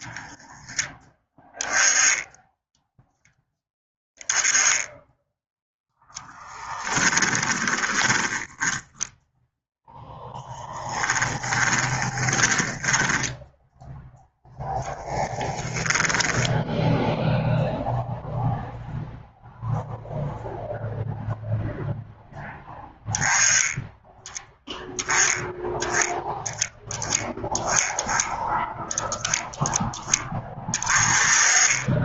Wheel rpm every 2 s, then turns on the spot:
10, 0, 10, 20, 10, 10, 20, 10, 0, 0, 0, 10, 10, 10, 10, 20.
6-8 10-14